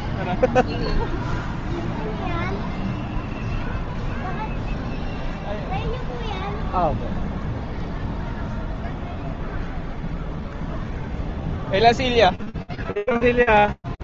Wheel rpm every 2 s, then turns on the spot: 0, 0, 0, 0, 0, 0, 0.
none